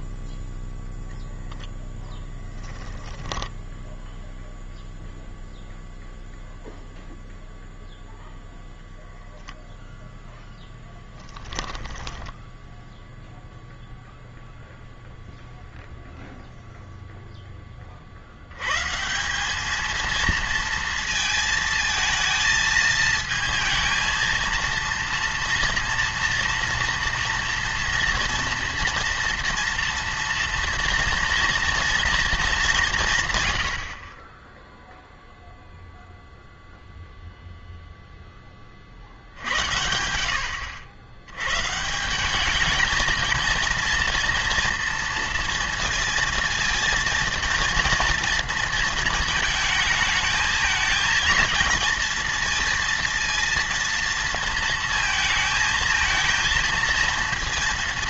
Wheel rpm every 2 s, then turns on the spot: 10, 10, 0, 0, 0, 10, 10, 0, 0, 110, 230, 220, 230, 230, 230, 230, 200, 0, 0, 20, 80, 210, 230, 230, 230, 220, 230, 230, 230.
2-4 10-14